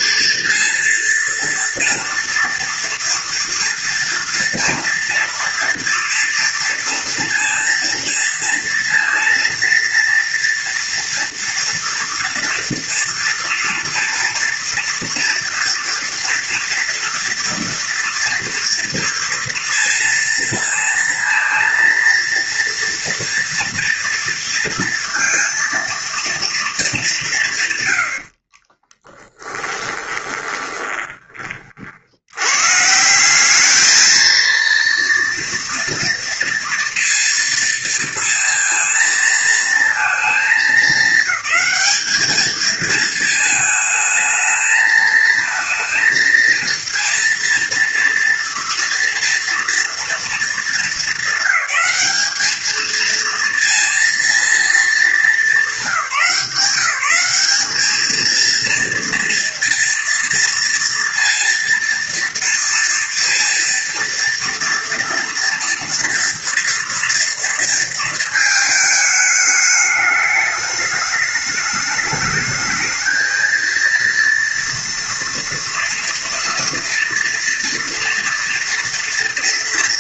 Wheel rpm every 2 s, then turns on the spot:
230, 230, 230, 230, 230, 240, 230, 230, 230, 230, 230, 230, 230, 200, 30, 20, 150, 230, 230, 230, 210, 220, 220, 230, 230, 210, 220, 220, 190, 230, 230, 230, 230, 230, 220, 210, 220, 230, 230, 240.
28-32